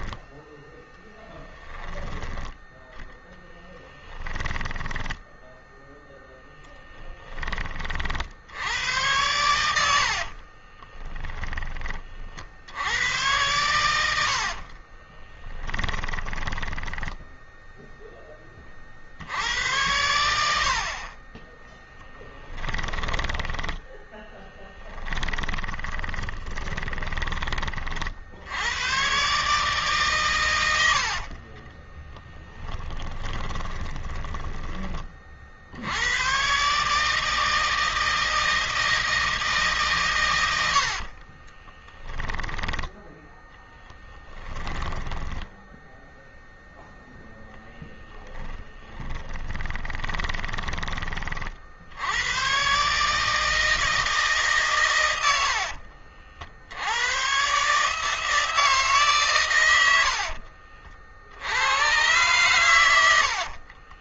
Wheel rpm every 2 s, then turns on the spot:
10, 10, 10, 10, 90, 20, 100, 30, 10, 60, 30, 10, 20, 20, 130, 60, 10, 30, 150, 160, 40, 0, 10, 20, 30, 30, 150, 90, 120, 130, 60, 90.
4-6 8-12 14-16 22-26 30-34 40-42 44-50 62-64